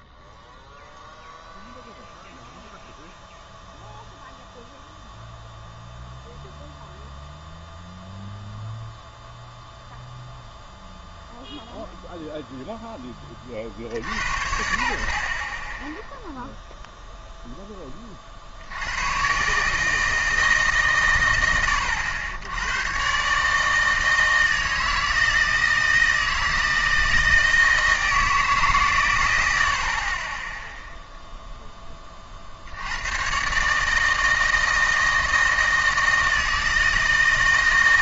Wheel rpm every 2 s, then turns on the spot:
0, 0, 0, 0, 0, 0, 0, 70, 0, 80, 140, 100, 160, 160, 150, 10, 50, 160, 160.
none